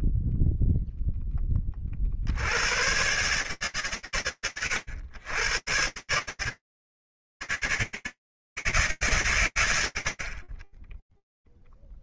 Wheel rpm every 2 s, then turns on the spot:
0, 80, 90, 140, 160, 50.
none